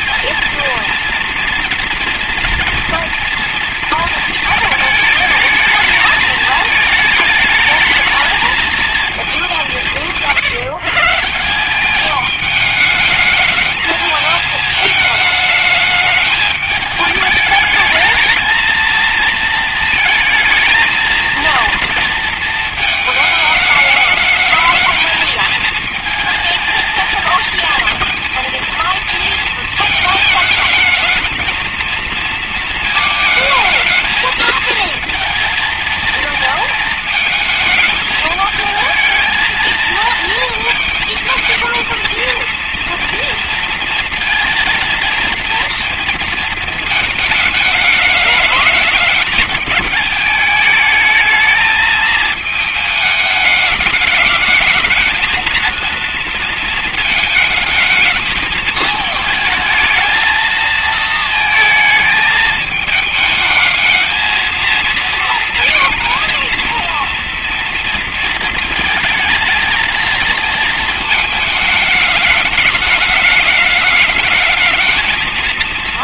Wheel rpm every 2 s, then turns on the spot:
240, 230, 230, 220, 220, 160, 210, 210, 210, 220, 230, 220, 210, 230, 230, 220, 220, 220, 220, 220, 220, 230, 230, 230, 210, 220, 220, 220, 230, 220, 220, 220, 230, 230, 230, 230, 220, 220.
none